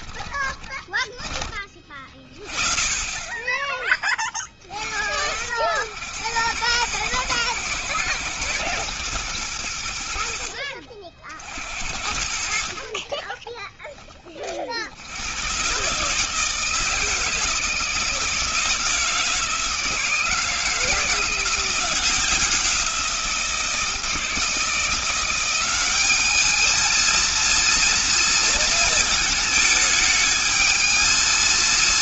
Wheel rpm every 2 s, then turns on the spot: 10, 30, 60, 100, 110, 50, 30, 70, 160, 160, 170, 170, 170, 220, 220, 220.
12-14